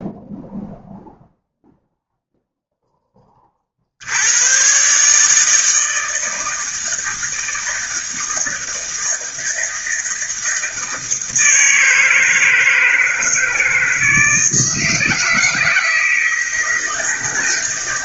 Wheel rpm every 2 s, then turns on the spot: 0, 10, 140, 160, 160, 160, 160, 160, 160.
none